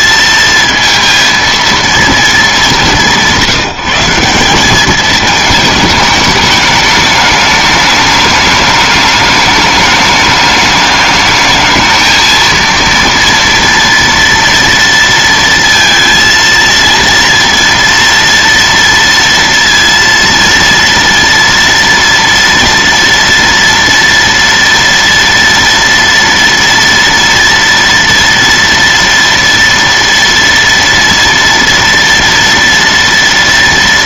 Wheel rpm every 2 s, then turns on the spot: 230, 210, 190, 210, 210, 210, 230, 230, 230, 230, 230, 230, 230, 230, 230, 230, 230.
none